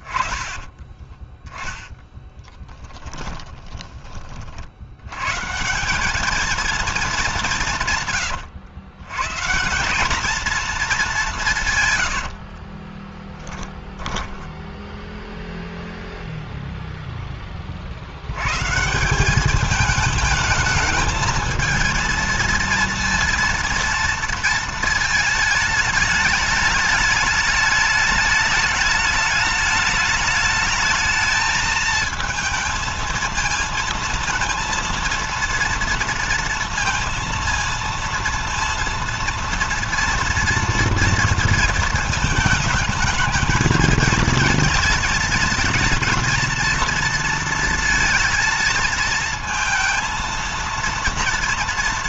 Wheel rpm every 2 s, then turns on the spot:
10, 20, 100, 220, 130, 210, 20, 0, 0, 150, 220, 230, 220, 210, 210, 210, 220, 230, 230, 230, 230, 220, 220, 230, 230, 230.
2-4 12-14